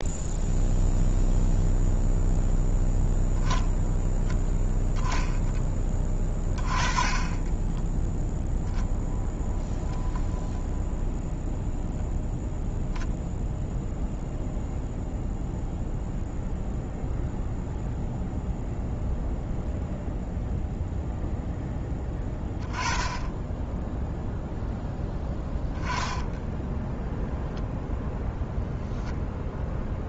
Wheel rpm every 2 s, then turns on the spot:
0, 0, 10, 20, 0, 0, 0, 0, 0, 0, 0, 20, 0, 10, 0.
26-28